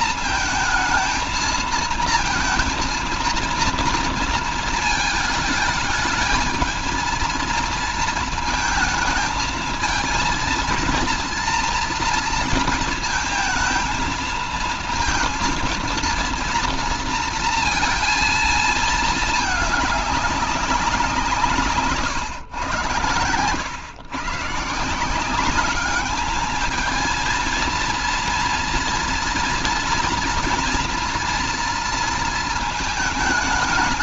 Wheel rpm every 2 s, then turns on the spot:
220, 230, 220, 220, 220, 230, 220, 220, 230, 220, 190, 110, 160, 220, 230, 240, 220.
none